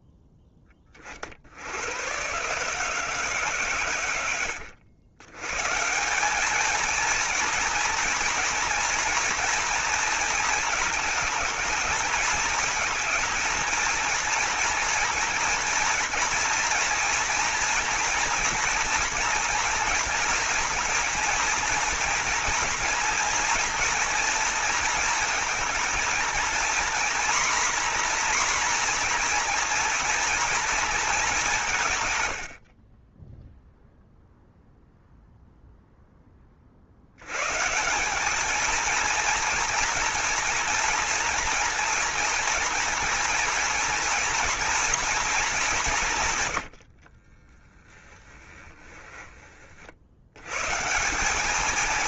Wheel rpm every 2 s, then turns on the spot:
20, 150, 100, 220, 230, 220, 220, 240, 230, 240, 240, 230, 230, 240, 250, 230, 40, 0, 60, 230, 240, 240, 240, 90, 20, 150.
32-34 46-50